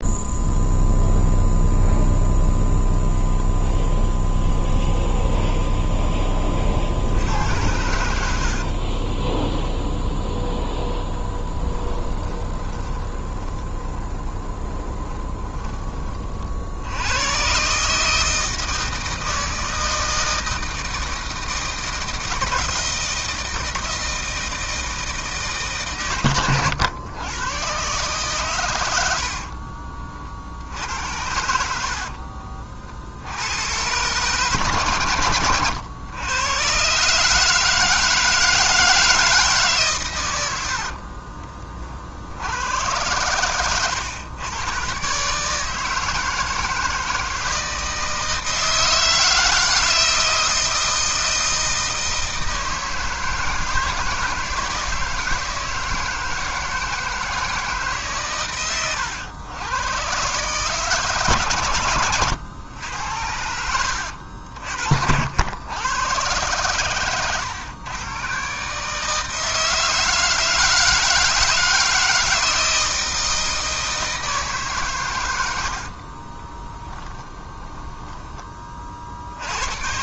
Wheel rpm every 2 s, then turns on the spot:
0, 0, 0, 60, 30, 10, 20, 20, 90, 160, 160, 160, 160, 100, 90, 80, 60, 120, 130, 160, 40, 100, 130, 160, 160, 160, 160, 160, 160, 110, 150, 100, 60, 110, 150, 160, 160, 130, 20, 50.
8-16 28-30 40-42 76-78